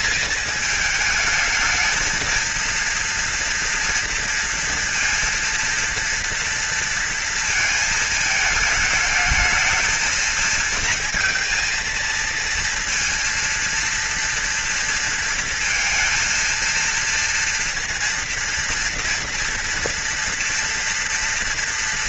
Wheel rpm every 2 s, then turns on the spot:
220, 230, 230, 230, 220, 220, 230, 230, 230, 230, 230.
none